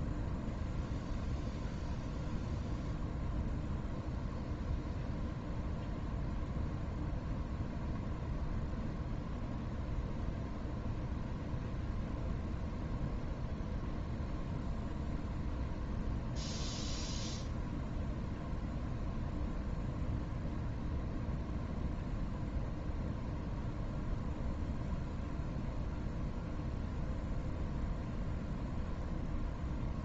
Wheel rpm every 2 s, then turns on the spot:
0, 0, 0, 0, 0, 0, 0, 0, 0, 0, 0, 0, 0, 0, 0.
none